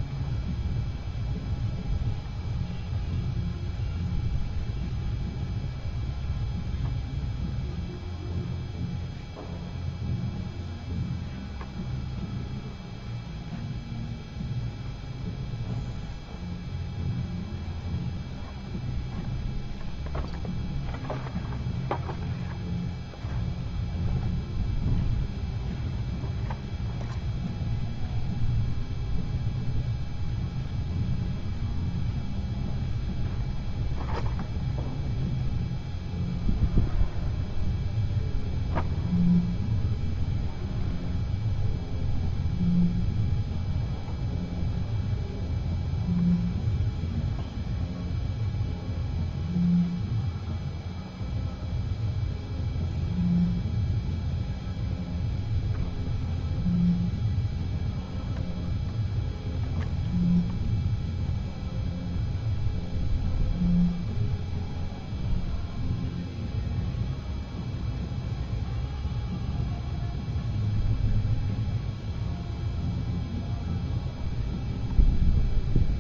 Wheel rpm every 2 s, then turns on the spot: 0, 0, 0, 0, 0, 0, 0, 0, 0, 0, 0, 0, 0, 0, 0, 0, 0, 0, 0, 0, 0, 0, 0, 0, 0, 0, 0, 0, 0, 0, 0, 0, 0, 0, 0, 0, 0, 0.
none